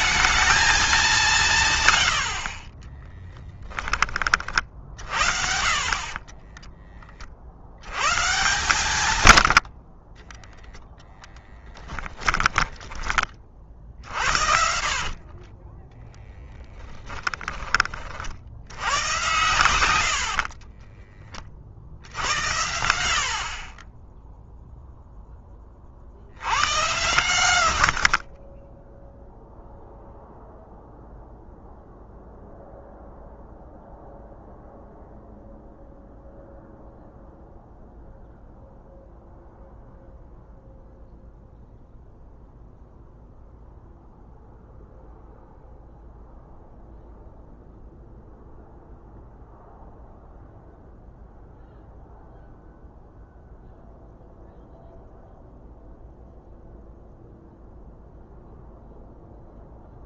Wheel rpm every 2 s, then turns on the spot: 200, 20, 50, 30, 130, 0, 20, 50, 10, 80, 20, 70, 0, 110, 10, 0, 0, 0, 0, 0, 0, 0, 0, 0, 0, 0, 0, 0, 0, 0.
2-4 20-22